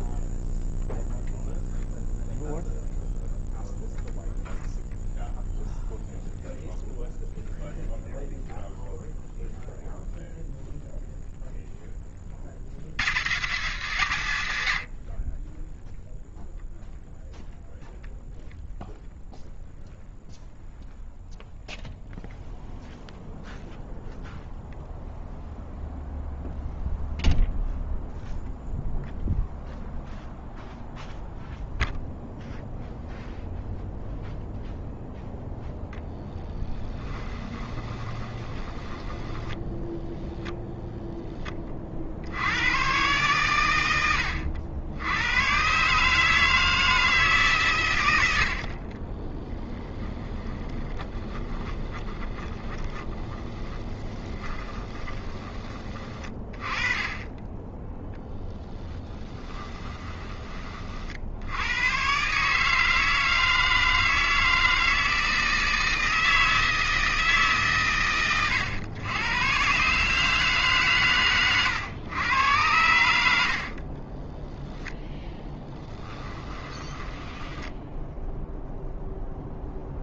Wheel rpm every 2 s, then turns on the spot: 0, 0, 0, 0, 0, 0, 60, 90, 0, 0, 0, 0, 0, 0, 0, 0, 0, 0, 10, 20, 0, 100, 100, 160, 60, 20, 20, 20, 20, 10, 30, 150, 160, 160, 110, 140, 100, 10, 20, 0.
36-40 48-56 74-78